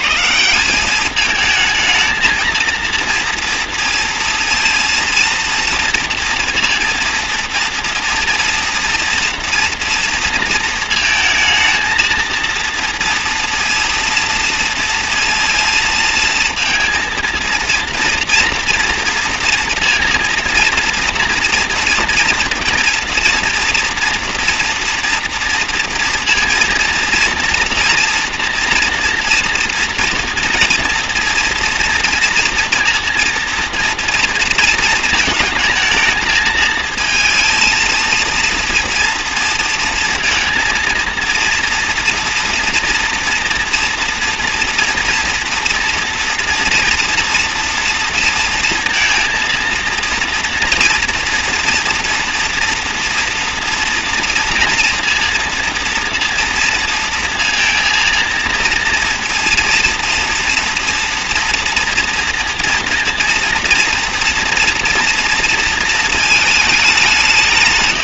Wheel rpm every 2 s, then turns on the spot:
200, 230, 230, 230, 230, 230, 230, 230, 230, 230, 230, 230, 230, 230, 230, 230, 230, 230, 220, 230, 230, 240, 230, 230, 220, 230, 230, 230, 230, 230, 230, 230, 230, 200.
none